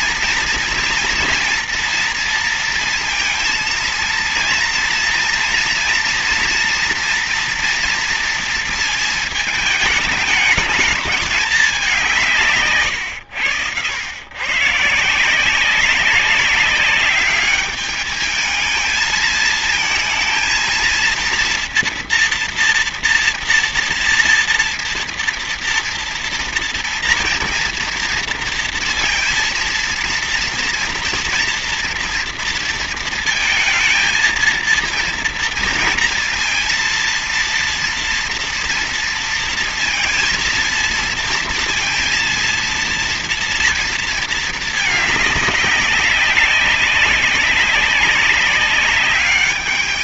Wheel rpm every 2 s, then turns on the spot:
230, 230, 230, 230, 230, 210, 160, 120, 200, 220, 220, 230, 230, 230, 230, 230, 230, 230, 230, 230, 230, 230, 210, 200, 200.
none